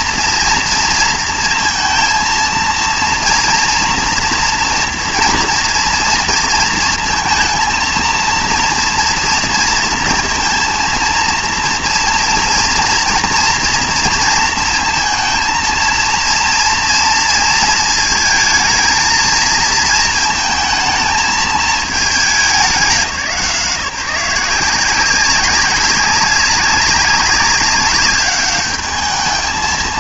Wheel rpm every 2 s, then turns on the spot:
230, 230, 240, 230, 230, 230, 230, 230, 230, 220, 220, 190, 180, 190, 210.
none